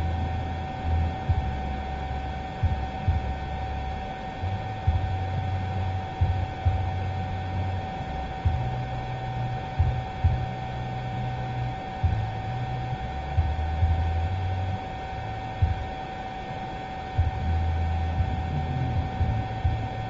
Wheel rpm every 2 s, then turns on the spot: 0, 0, 0, 0, 0, 0, 0, 0, 0, 0.
none